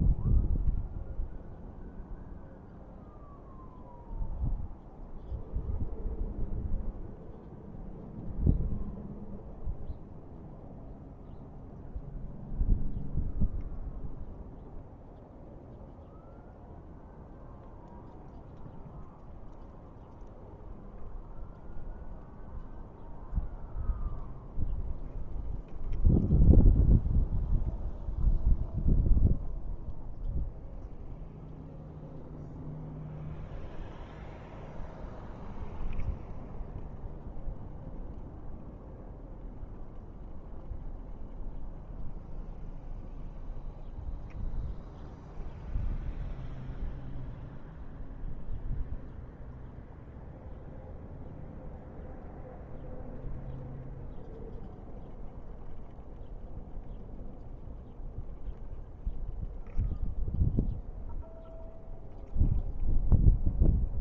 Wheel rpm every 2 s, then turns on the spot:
0, 0, 0, 0, 0, 0, 0, 0, 0, 0, 0, 0, 0, 0, 0, 0, 0, 0, 0, 0, 0, 0, 0, 0, 0, 0, 0, 0, 0, 0, 0, 0.
none